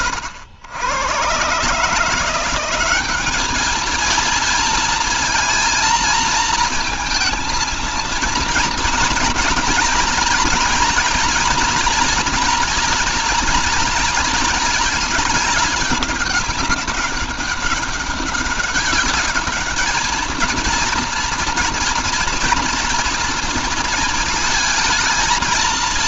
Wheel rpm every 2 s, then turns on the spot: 100, 190, 230, 230, 240, 240, 240, 220, 190, 200, 230, 230, 220.
none